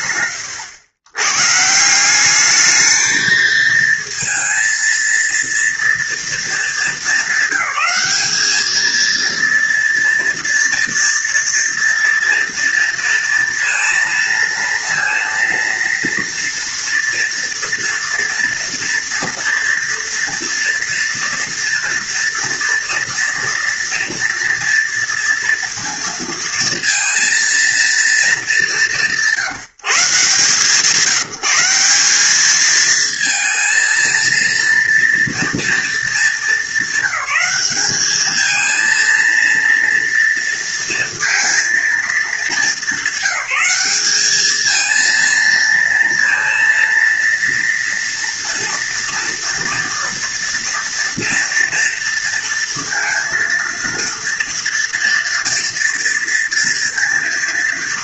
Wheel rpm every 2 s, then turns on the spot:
110, 220, 230, 220, 230, 230, 230, 230, 230, 240, 230, 230, 230, 230, 180, 180, 230, 230, 200, 230, 230, 200, 220, 230, 230, 230, 230, 230, 230.
none